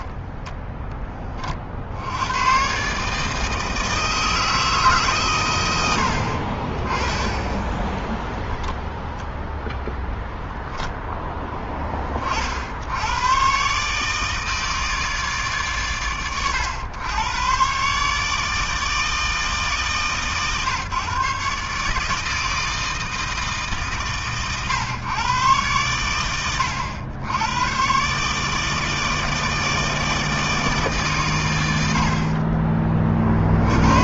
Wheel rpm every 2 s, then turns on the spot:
20, 150, 120, 20, 0, 10, 140, 140, 100, 140, 140, 140, 110, 100, 160, 130, 50.
none